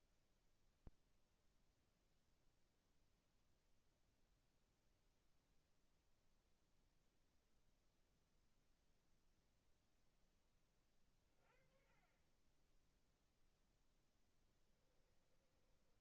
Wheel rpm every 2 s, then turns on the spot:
0, 0, 0, 0, 0, 10, 10, 10.
14-16